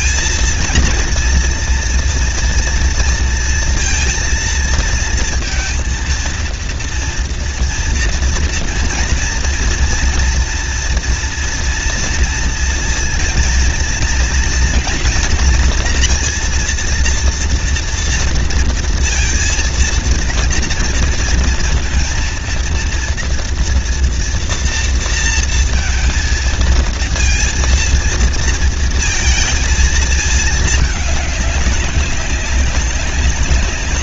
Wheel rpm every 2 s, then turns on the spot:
230, 230, 230, 230, 230, 230, 230, 230, 230, 230, 230, 230, 230, 230, 230, 210, 200.
none